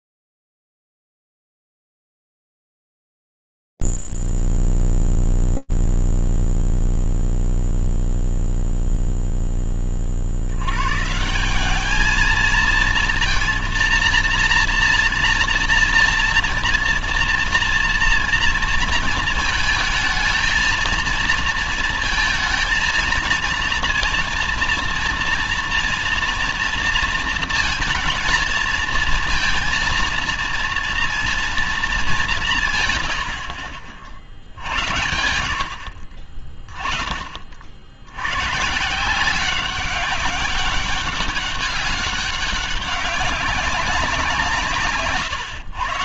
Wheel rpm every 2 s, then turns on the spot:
0, 0, 0, 0, 0, 100, 230, 230, 240, 230, 230, 230, 230, 230, 230, 230, 140, 90, 30, 170, 200, 200, 120.
none